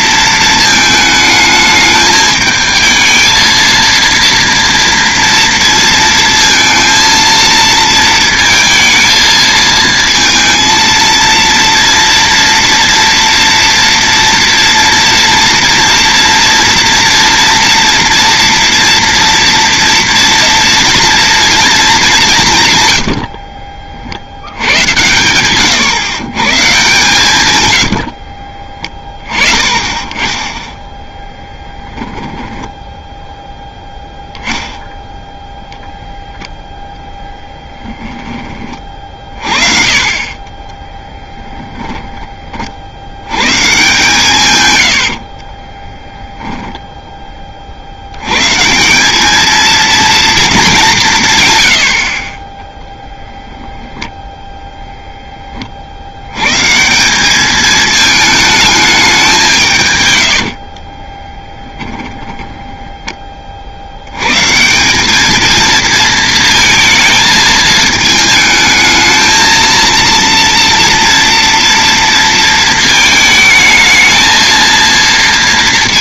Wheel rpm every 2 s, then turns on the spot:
220, 220, 230, 230, 220, 230, 230, 230, 230, 230, 230, 120, 110, 140, 30, 10, 10, 0, 0, 30, 20, 50, 110, 0, 150, 210, 10, 10, 150, 210, 50, 10, 170, 230, 220, 230, 230, 230.
22-26 44-46 60-62